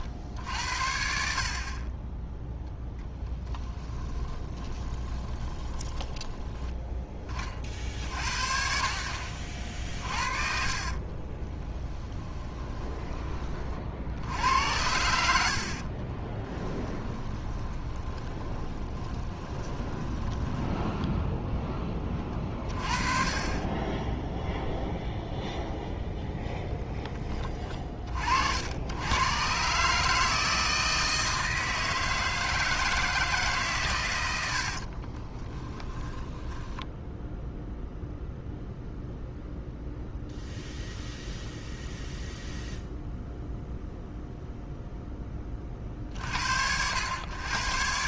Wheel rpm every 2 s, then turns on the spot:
60, 0, 20, 10, 60, 40, 20, 90, 10, 20, 10, 30, 0, 10, 90, 160, 160, 60, 10, 0, 0, 0, 0, 90.
4-6 10-14 16-22 34-38